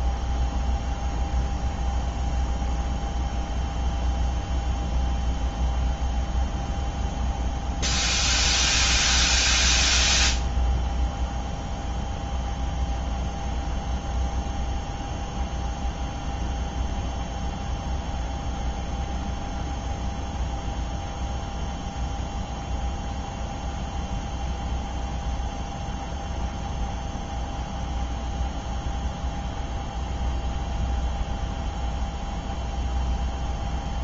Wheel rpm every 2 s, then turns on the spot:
0, 0, 0, 0, 0, 0, 0, 0, 0, 0, 0, 0, 0, 0, 0, 0, 0.
none